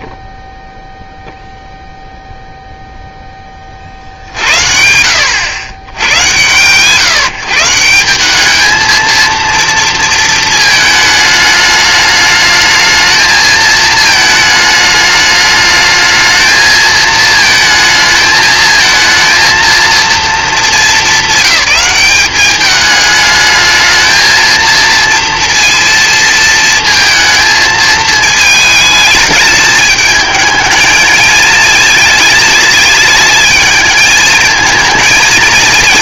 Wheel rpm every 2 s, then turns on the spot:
0, 0, 70, 130, 210, 220, 220, 220, 220, 230, 210, 210, 230, 230, 220, 220, 220, 220.
none